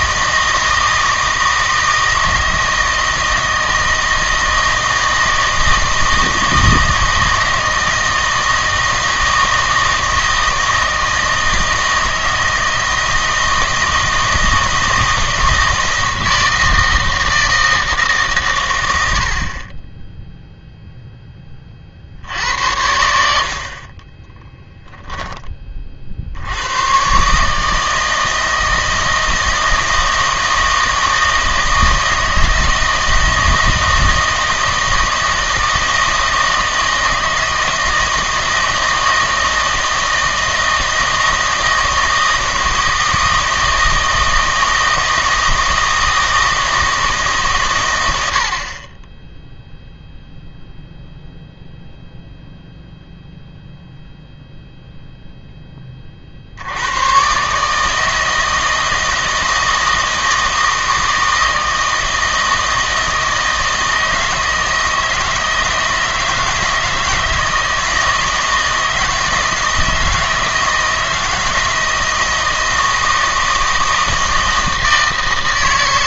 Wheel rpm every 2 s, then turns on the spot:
160, 160, 160, 160, 160, 160, 160, 160, 160, 100, 0, 90, 10, 100, 160, 160, 160, 160, 160, 160, 160, 160, 160, 160, 20, 0, 0, 0, 90, 160, 160, 160, 160, 160, 160, 160, 160, 160.
none